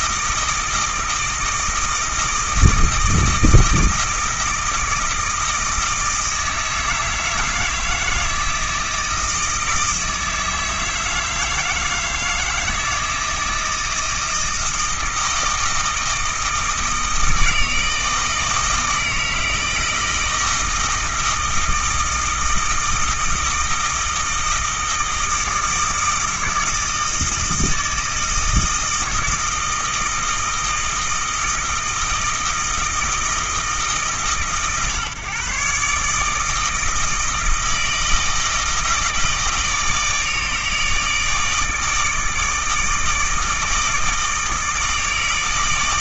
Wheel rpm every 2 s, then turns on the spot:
160, 160, 160, 160, 160, 160, 160, 160, 160, 160, 160, 160, 160, 160, 160, 160, 160, 140, 160, 160, 150, 160, 160.
none